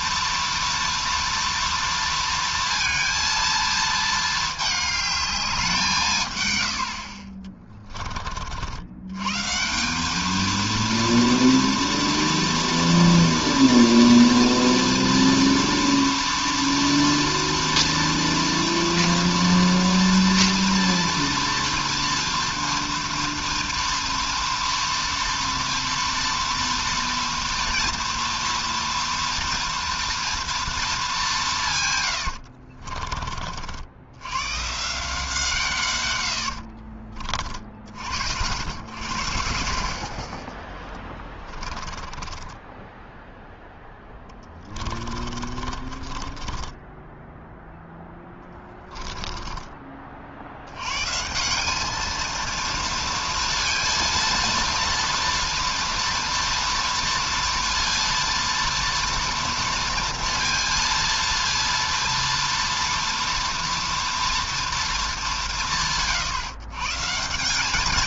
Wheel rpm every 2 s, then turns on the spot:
230, 230, 220, 120, 50, 220, 230, 230, 230, 230, 230, 230, 230, 230, 230, 230, 70, 120, 80, 80, 20, 20, 10, 20, 10, 70, 230, 230, 230, 230, 230, 230, 230, 140.
32-34 36-38 42-48